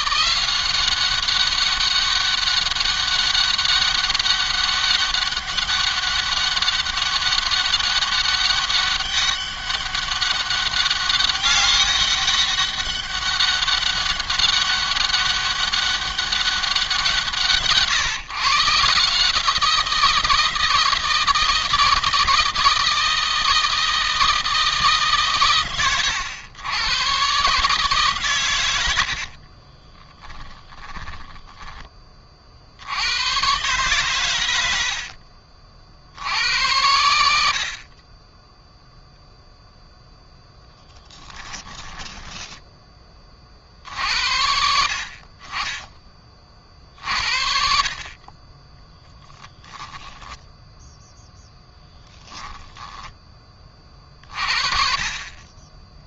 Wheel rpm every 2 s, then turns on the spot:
190, 200, 200, 200, 200, 200, 200, 200, 180, 150, 160, 160, 160, 120, 100, 10, 70, 80, 80, 10, 10, 20, 50, 40, 10, 0, 10, 40.
28-32 34-36 40-42 48-50